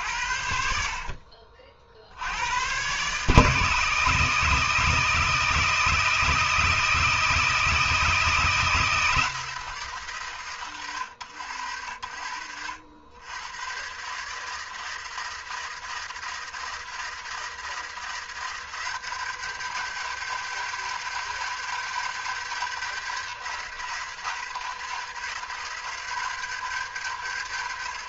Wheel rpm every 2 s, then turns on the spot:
80, 160, 160, 160, 160, 70, 150, 160, 160, 200, 200, 170, 160, 140.
none